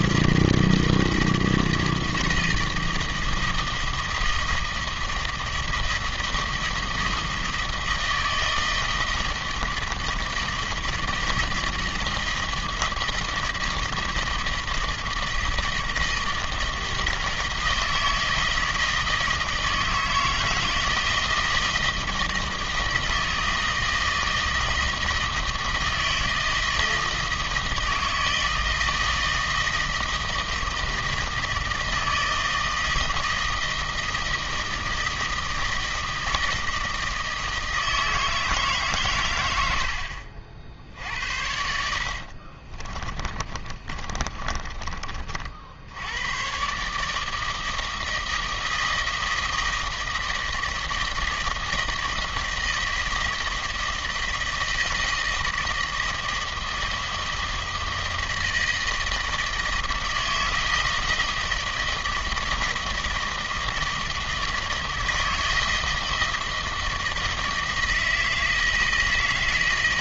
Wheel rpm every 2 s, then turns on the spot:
160, 160, 160, 160, 160, 160, 160, 160, 160, 160, 160, 160, 160, 160, 160, 160, 160, 160, 160, 130, 70, 30, 30, 150, 160, 160, 170, 160, 160, 160, 160, 160, 160, 160, 160.
42-44